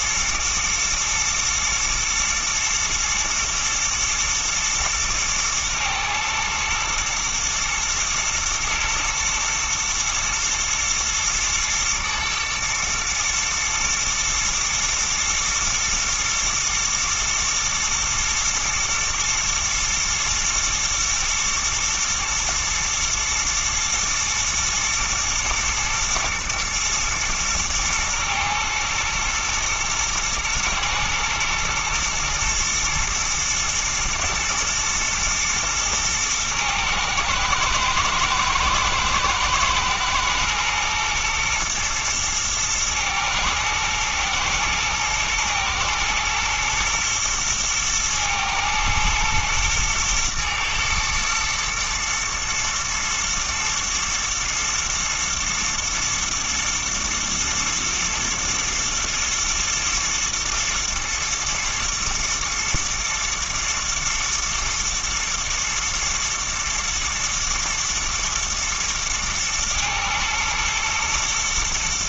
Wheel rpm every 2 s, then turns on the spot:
110, 120, 110, 110, 110, 110, 120, 110, 120, 110, 120, 120, 110, 120, 110, 110, 120, 110, 110, 110, 120, 120, 120, 120, 110, 120, 110, 120, 110, 110, 110, 120, 110, 110, 110, 110.
none